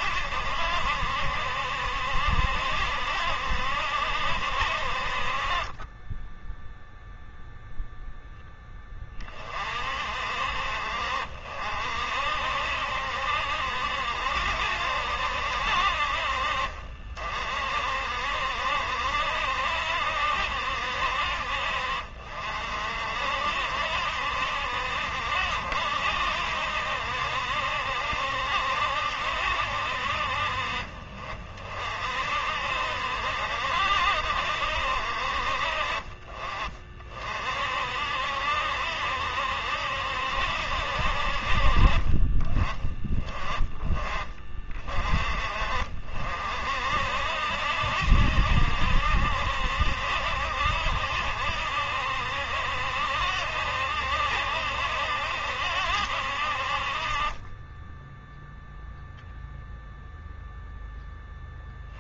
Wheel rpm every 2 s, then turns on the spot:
70, 70, 50, 0, 30, 50, 70, 70, 50, 70, 60, 60, 70, 70, 70, 50, 70, 60, 40, 70, 60, 20, 30, 60, 70, 70, 70, 70, 50, 0, 10.
none